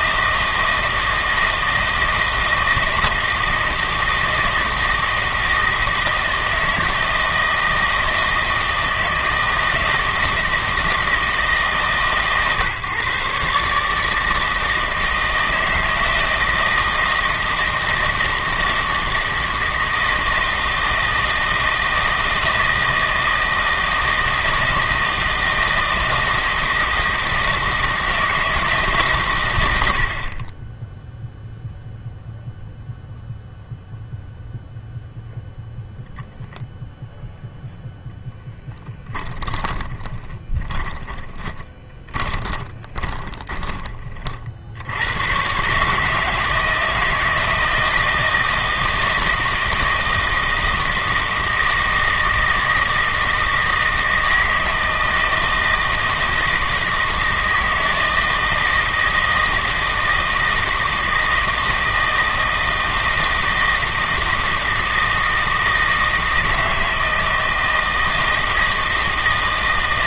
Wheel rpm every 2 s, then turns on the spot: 160, 160, 160, 160, 160, 160, 140, 160, 160, 160, 160, 160, 160, 160, 150, 10, 0, 0, 0, 10, 10, 20, 70, 160, 160, 160, 160, 160, 160, 160, 160, 160, 160, 160, 160.
40-44